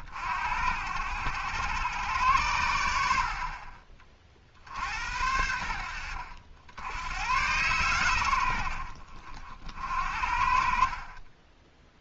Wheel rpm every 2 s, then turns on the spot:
80, 90, 60, 90, 70, 50.
10-12